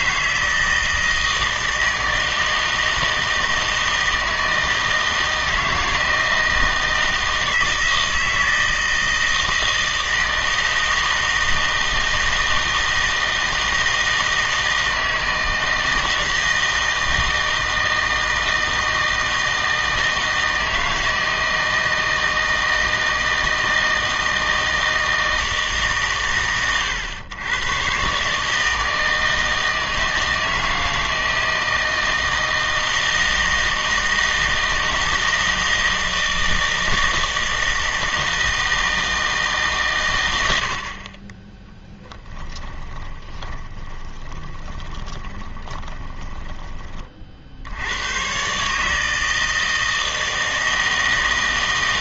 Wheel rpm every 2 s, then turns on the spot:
160, 160, 160, 160, 160, 160, 160, 160, 160, 160, 160, 160, 160, 110, 160, 160, 160, 160, 160, 160, 70, 20, 20, 30, 150, 160.
42-46